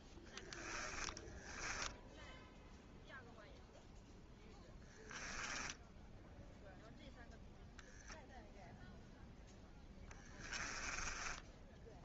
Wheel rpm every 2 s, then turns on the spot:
10, 0, 10, 0, 0, 10.
0-2 4-6 10-12